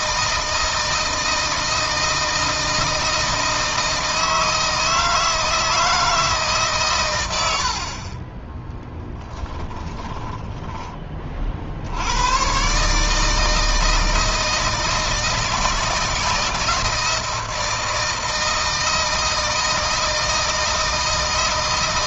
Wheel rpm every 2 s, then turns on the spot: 160, 160, 160, 140, 10, 20, 130, 160, 160, 160, 160.
8-10